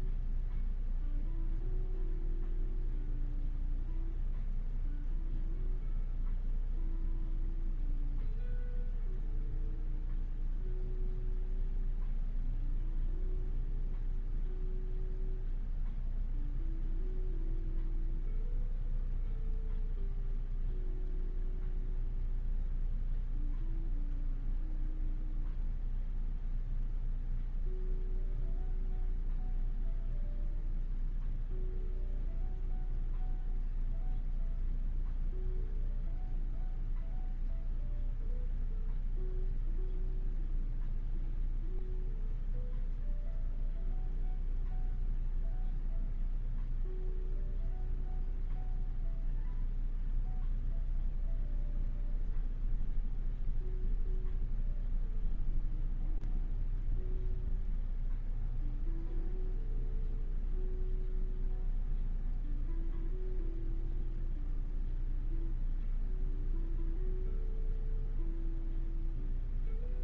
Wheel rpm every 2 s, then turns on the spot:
0, 0, 0, 0, 0, 0, 0, 0, 0, 0, 0, 0, 0, 0, 0, 0, 0, 0, 0, 0, 0, 0, 0, 0, 0, 0, 0, 0, 0, 0, 0, 0, 0, 0, 0.
none